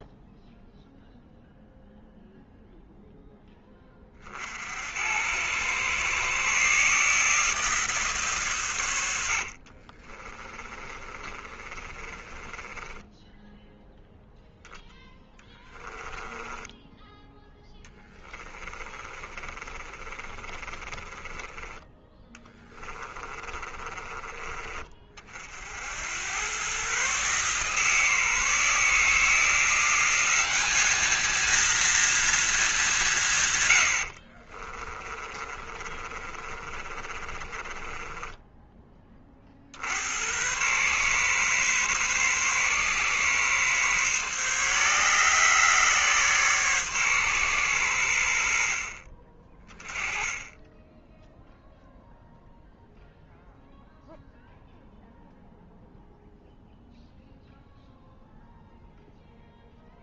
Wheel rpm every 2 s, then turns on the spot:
0, 0, 80, 150, 90, 30, 20, 10, 10, 30, 30, 30, 30, 130, 160, 210, 180, 20, 30, 20, 120, 140, 140, 140, 50, 10, 0, 0, 0, 0.
10-16 18-24 34-38